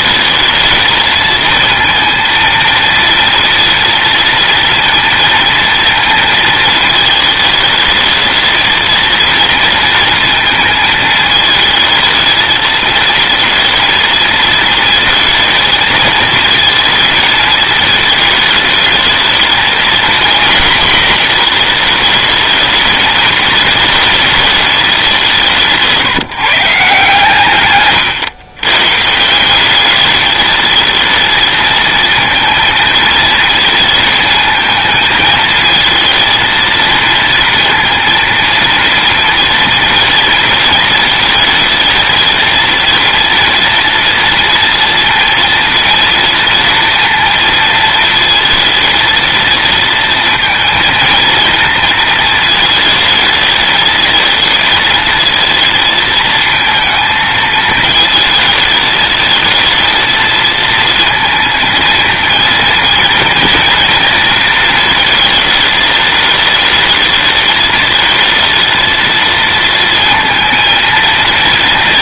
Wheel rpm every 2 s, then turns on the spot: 220, 230, 230, 220, 230, 220, 220, 230, 220, 220, 230, 220, 200, 150, 140, 220, 230, 220, 230, 230, 220, 230, 230, 230, 230, 230, 220, 220, 230, 220, 230, 230, 220, 220, 230, 230.
none